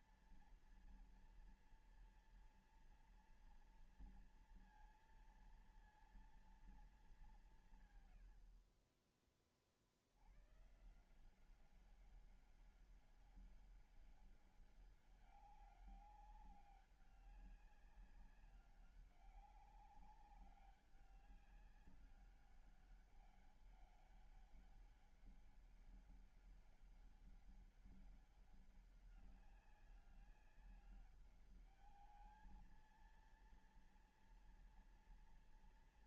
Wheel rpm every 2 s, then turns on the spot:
230, 230, 230, 230, 100, 90, 190, 200, 200, 200, 190, 200, 200, 200, 200, 190, 220, 230.
none